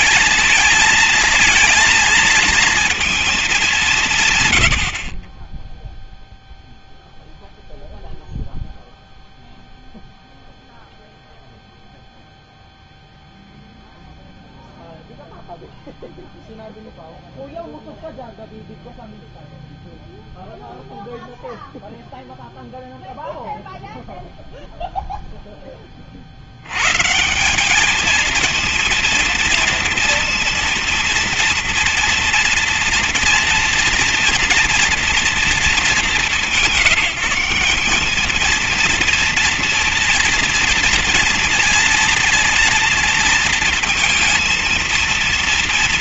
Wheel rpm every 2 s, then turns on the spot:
220, 230, 130, 0, 0, 0, 0, 0, 0, 0, 0, 0, 0, 90, 230, 230, 230, 230, 180, 220, 230, 230, 230.
none